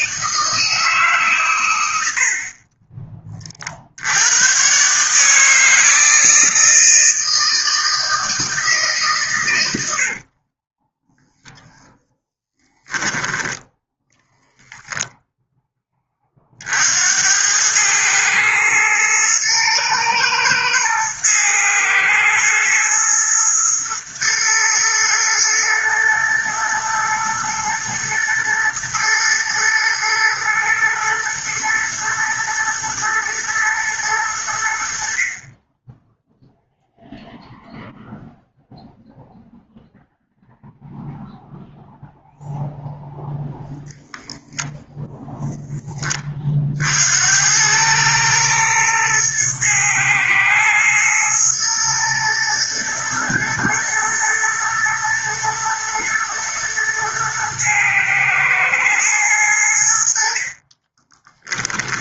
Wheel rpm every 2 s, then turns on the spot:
150, 30, 140, 160, 140, 10, 10, 0, 70, 110, 110, 110, 110, 110, 120, 120, 110, 60, 0, 0, 0, 0, 0, 70, 110, 120, 120, 110, 110, 110, 20.
10-12 60-62